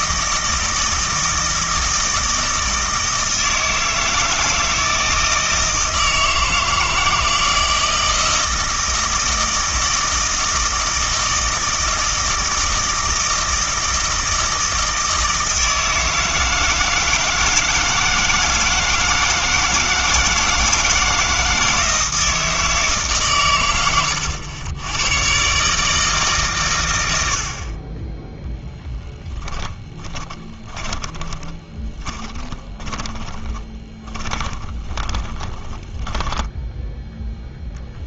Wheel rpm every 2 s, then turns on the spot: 160, 160, 160, 160, 160, 160, 160, 160, 160, 160, 160, 160, 90, 130, 0, 20, 10, 20, 10.
30-38